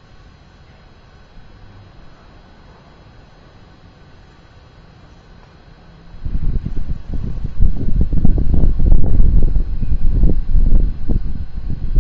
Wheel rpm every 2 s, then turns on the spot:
0, 0, 0, 0, 0, 0.
none